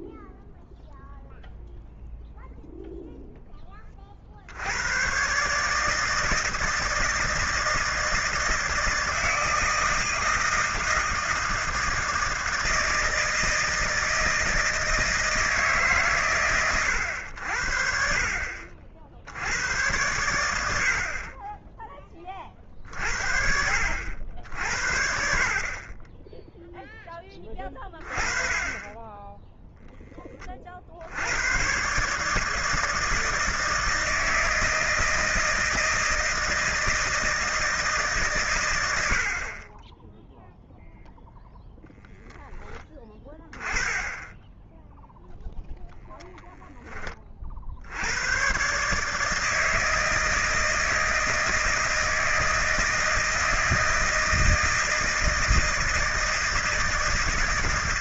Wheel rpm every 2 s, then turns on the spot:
0, 0, 70, 160, 160, 160, 160, 160, 120, 60, 90, 40, 70, 10, 20, 30, 150, 160, 160, 120, 0, 10, 10, 10, 120, 160, 160, 160, 160.
none